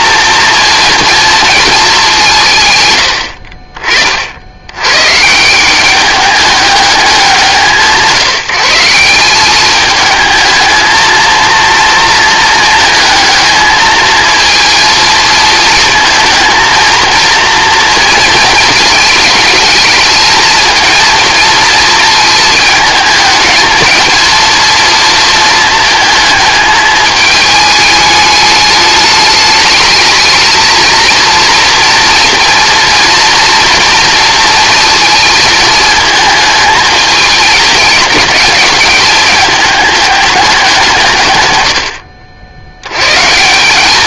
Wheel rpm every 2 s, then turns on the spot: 230, 120, 110, 200, 170, 230, 220, 230, 230, 220, 220, 220, 230, 210, 210, 230, 230, 230, 210, 210, 180, 90.
none